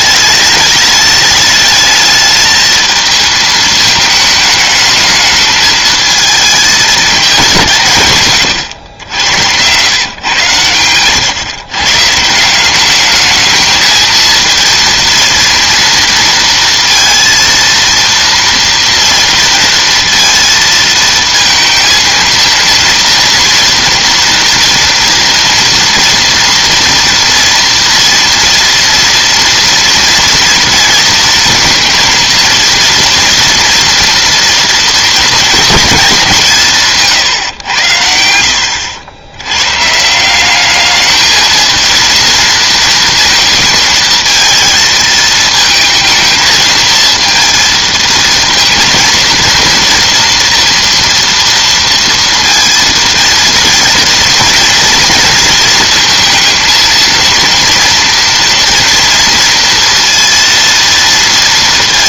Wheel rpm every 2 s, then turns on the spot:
210, 220, 210, 220, 120, 120, 170, 230, 230, 230, 230, 230, 230, 230, 230, 230, 230, 230, 170, 70, 180, 230, 230, 220, 230, 230, 230, 230, 230, 240, 230.
38-40